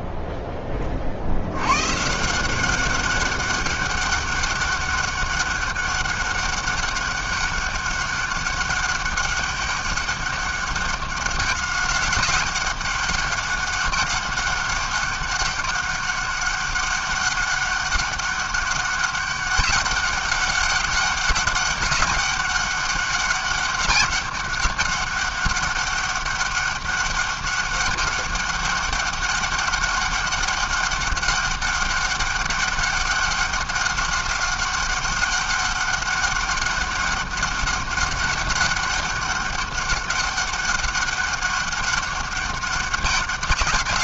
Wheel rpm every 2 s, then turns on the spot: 10, 180, 200, 200, 200, 200, 190, 200, 200, 200, 200, 200, 200, 200, 200, 200, 200, 200, 200, 200, 200, 200.
none